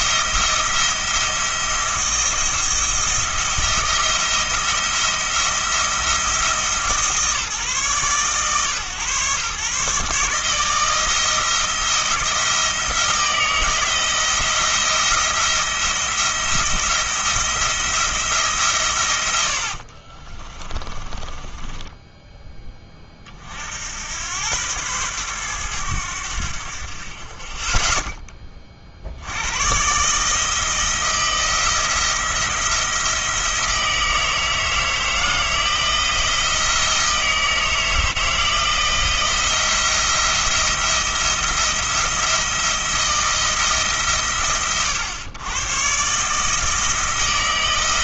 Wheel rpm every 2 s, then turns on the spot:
170, 170, 170, 160, 110, 160, 170, 170, 170, 140, 20, 20, 110, 70, 40, 160, 170, 160, 160, 170, 170, 170, 90, 160.
20-22